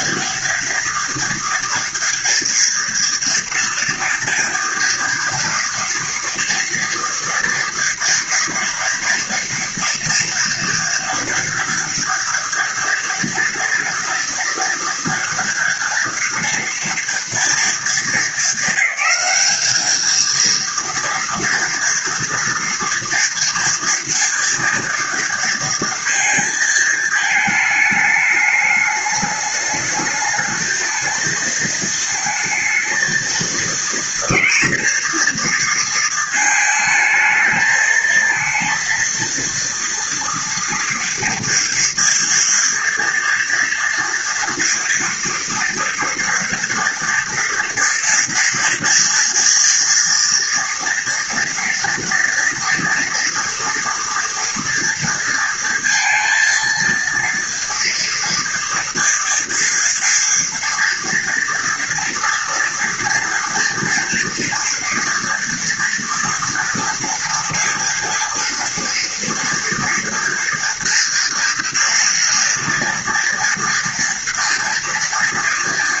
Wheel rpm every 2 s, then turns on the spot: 230, 230, 230, 230, 230, 230, 230, 230, 240, 220, 230, 240, 230, 220, 210, 220, 230, 230, 220, 220, 230, 240, 230, 230, 230, 230, 230, 230, 230, 230, 230, 230, 230, 230, 230, 230, 230, 230.
none